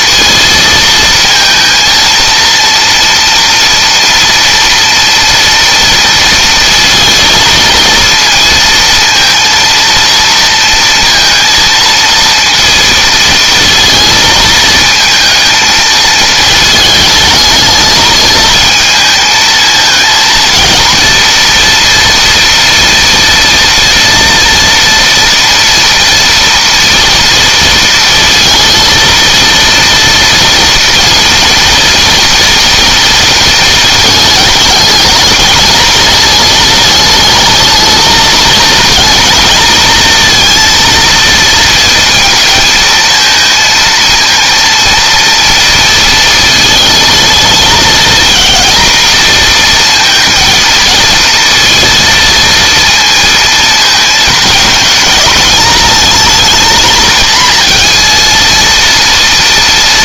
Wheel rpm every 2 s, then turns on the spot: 230, 230, 230, 230, 230, 230, 230, 220, 220, 220, 230, 230, 230, 230, 230, 230, 230, 220, 220, 230, 230, 220, 230, 230, 230, 220, 230, 210, 230, 230.
none